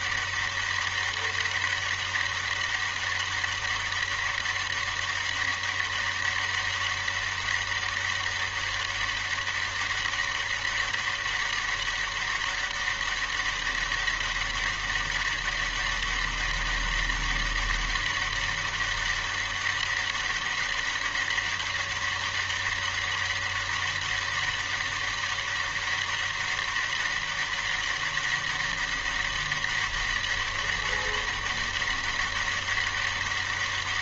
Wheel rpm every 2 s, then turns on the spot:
200, 200, 200, 200, 200, 200, 200, 200, 200, 200, 200, 200, 200, 200, 200, 200, 200.
none